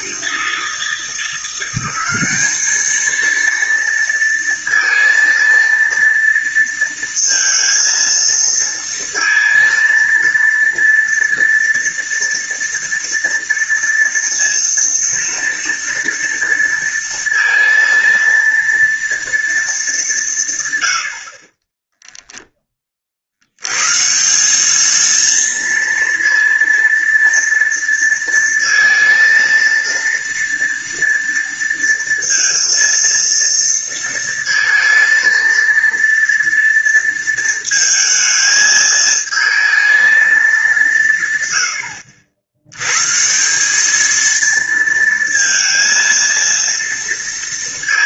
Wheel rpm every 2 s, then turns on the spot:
170, 220, 230, 230, 230, 230, 230, 230, 230, 230, 100, 30, 220, 230, 230, 230, 230, 230, 230, 220, 160, 130, 230, 230.
none